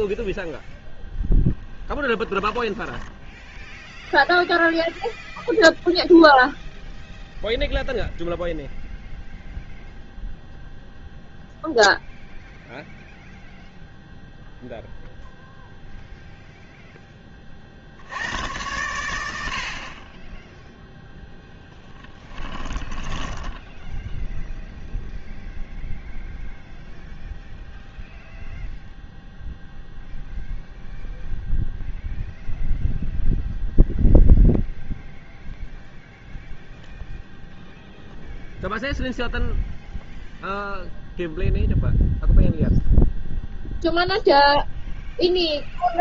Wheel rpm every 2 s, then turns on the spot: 0, 10, 0, 0, 0, 0, 0, 0, 0, 110, 0, 10, 0, 0, 0, 0, 0, 0, 0, 0, 0, 0, 0.
2-4 22-24